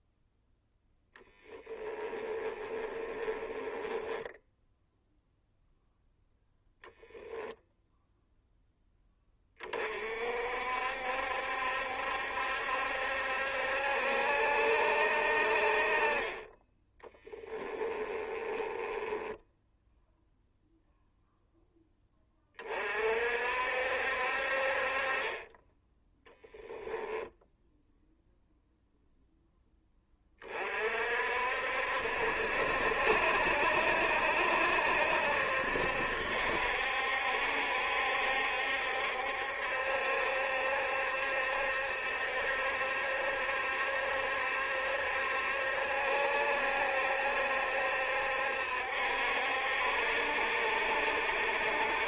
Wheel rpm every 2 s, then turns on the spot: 0, 20, 0, 0, 10, 60, 70, 60, 20, 10, 0, 40, 40, 0, 0, 50, 70, 70, 70, 70, 70, 70, 70, 70, 70, 70.
2-4 18-20